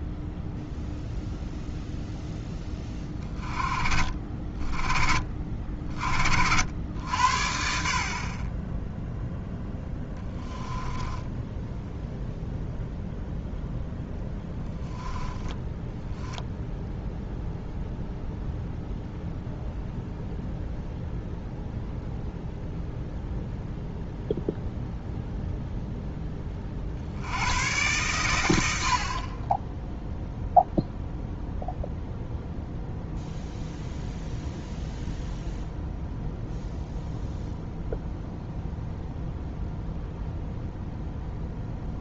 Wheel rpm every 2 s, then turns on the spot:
0, 20, 40, 80, 10, 10, 0, 10, 0, 0, 0, 0, 0, 70, 60, 0, 0, 0, 0, 0, 0.
10-12 14-16